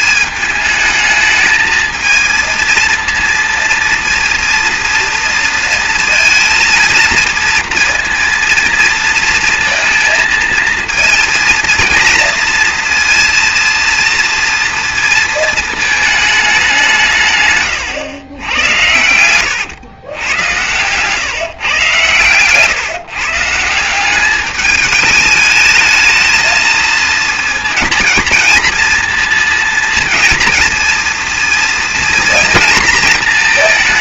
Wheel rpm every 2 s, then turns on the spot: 210, 230, 240, 220, 230, 230, 230, 230, 180, 100, 120, 140, 210, 220, 230, 230, 230.
20-22